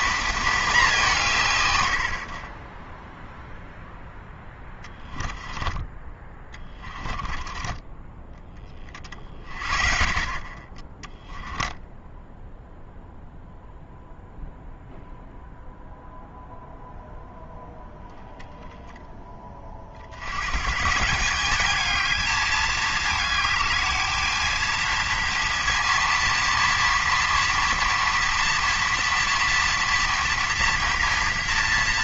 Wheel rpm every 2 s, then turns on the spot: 200, 10, 10, 20, 40, 20, 0, 0, 0, 10, 150, 220, 230, 230, 230, 240.
4-8